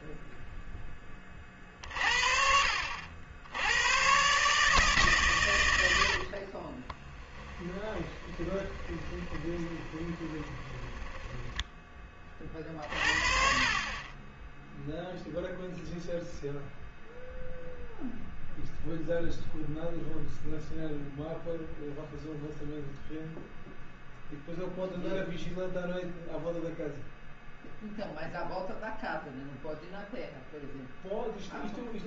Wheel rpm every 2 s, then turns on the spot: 0, 60, 150, 40, 20, 20, 40, 0, 0, 0, 0, 0, 0, 0, 0, 0.
6-12